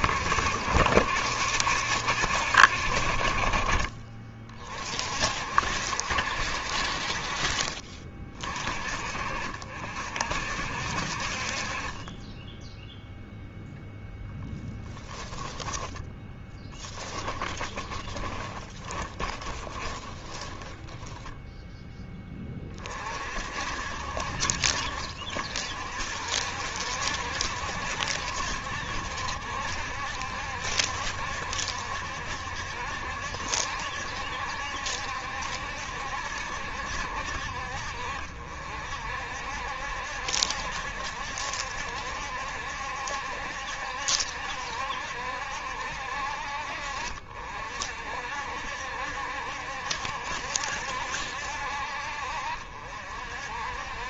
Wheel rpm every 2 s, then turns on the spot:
60, 50, 40, 60, 40, 60, 0, 10, 10, 20, 10, 30, 60, 60, 70, 70, 70, 70, 70, 60, 70, 70, 70, 50, 60, 70, 50.
14-22